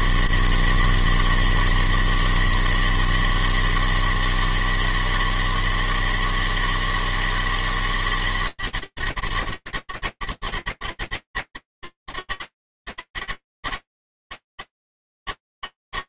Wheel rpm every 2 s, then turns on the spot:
120, 160, 160, 160, 160, 150, 160, 160.
none